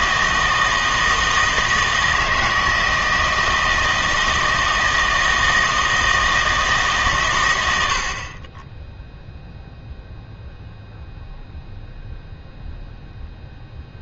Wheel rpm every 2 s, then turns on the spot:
160, 160, 160, 160, 20, 0, 0.
none